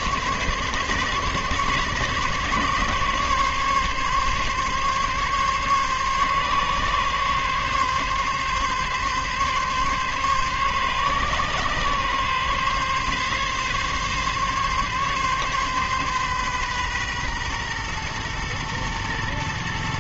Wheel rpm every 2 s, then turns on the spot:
140, 140, 140, 140, 140, 130, 140, 140, 130, 120.
none